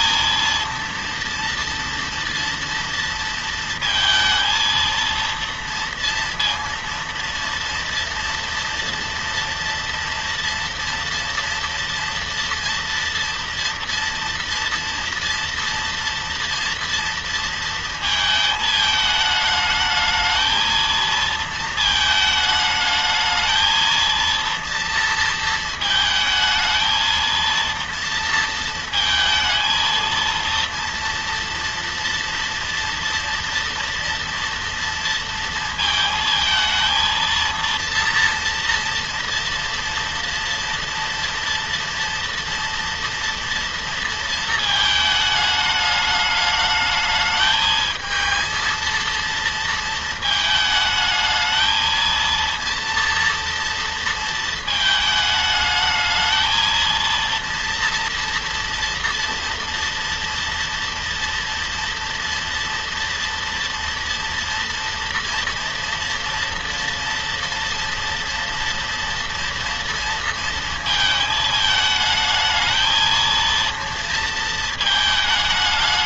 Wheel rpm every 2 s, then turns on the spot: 230, 230, 230, 230, 230, 230, 230, 240, 230, 220, 220, 220, 230, 220, 230, 230, 230, 230, 220, 230, 230, 230, 230, 210, 220, 220, 230, 220, 230, 230, 240, 230, 240, 230, 230, 230, 220, 230.
none